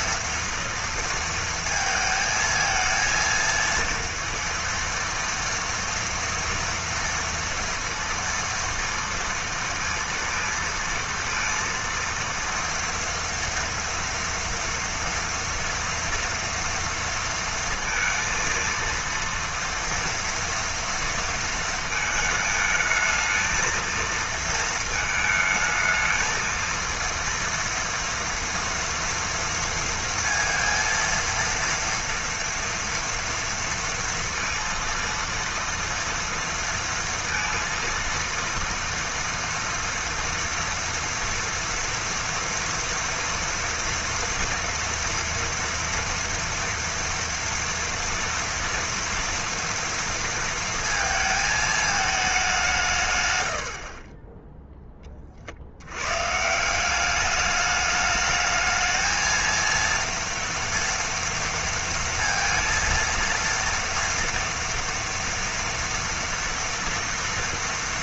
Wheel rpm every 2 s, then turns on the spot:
230, 220, 230, 230, 230, 230, 230, 230, 230, 230, 230, 220, 220, 230, 230, 230, 230, 230, 230, 230, 230, 230, 230, 240, 230, 230, 170, 10, 170, 220, 230, 230, 230, 230.
none